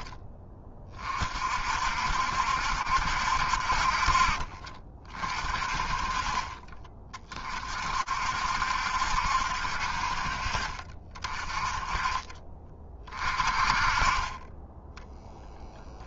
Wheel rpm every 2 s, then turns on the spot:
30, 70, 40, 30, 60, 50, 30, 20.
14-16